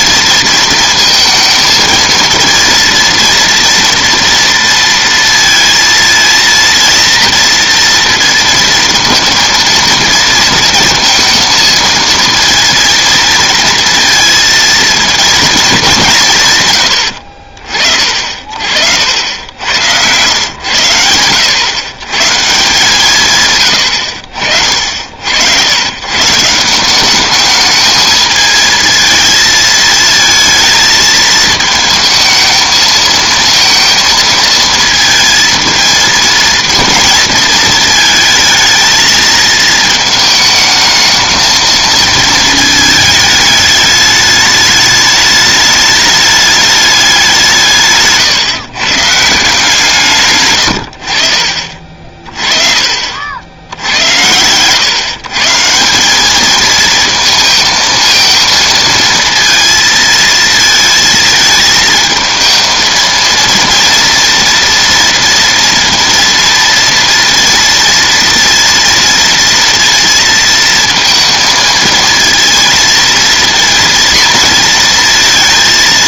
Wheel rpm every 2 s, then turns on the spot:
230, 230, 230, 230, 230, 230, 230, 230, 140, 50, 110, 150, 60, 180, 220, 220, 220, 230, 230, 220, 220, 220, 210, 210, 130, 100, 40, 110, 220, 230, 220, 230, 230, 230, 230, 230, 230, 230.
52-54